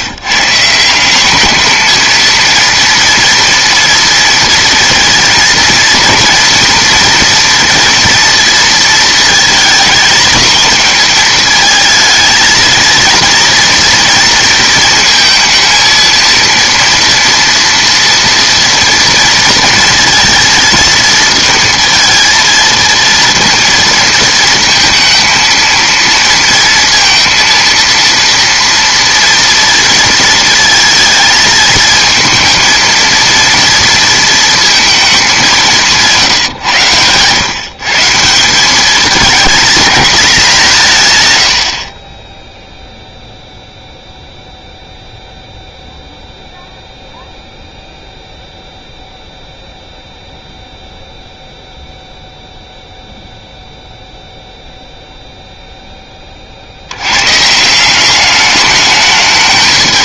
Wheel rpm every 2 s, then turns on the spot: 150, 230, 230, 230, 230, 220, 230, 230, 230, 230, 230, 230, 220, 230, 230, 230, 230, 230, 140, 190, 190, 0, 0, 0, 0, 0, 0, 0, 50, 200.
none